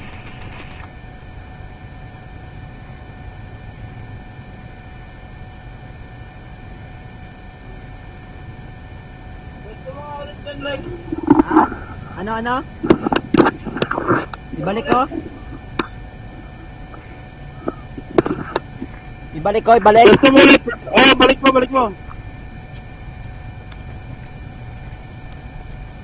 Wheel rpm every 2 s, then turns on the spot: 10, 0, 0, 0, 0, 0, 0, 0, 0, 0, 0, 0, 0.
0-2